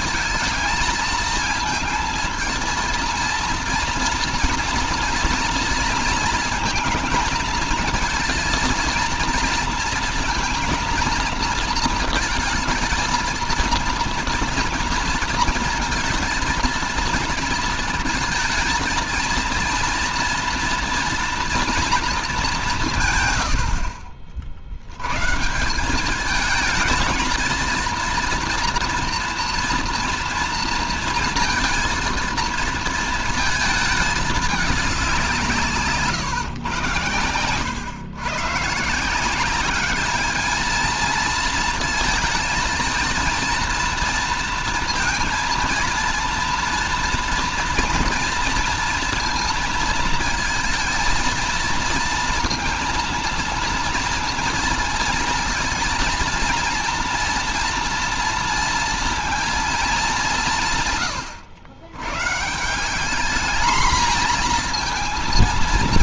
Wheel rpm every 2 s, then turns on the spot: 220, 230, 230, 220, 230, 230, 220, 230, 230, 230, 230, 160, 90, 220, 230, 230, 230, 200, 130, 170, 220, 230, 230, 230, 230, 230, 230, 230, 230, 230, 130, 190, 230.
none